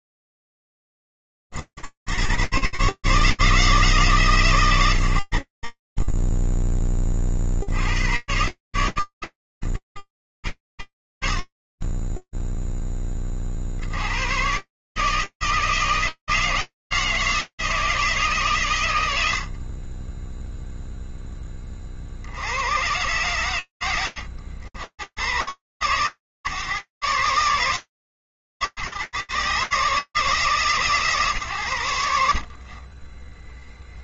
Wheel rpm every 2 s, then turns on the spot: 0, 20, 150, 30, 100, 50, 10, 150, 160, 130, 0, 40, 110, 130, 150, 150, 40.
none